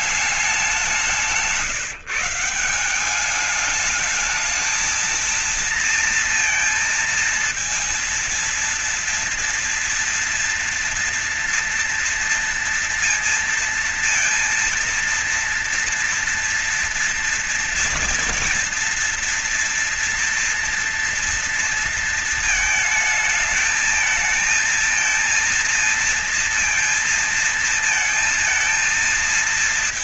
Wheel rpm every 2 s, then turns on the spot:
190, 190, 220, 230, 230, 240, 230, 230, 230, 240, 230, 220, 220, 230, 210.
none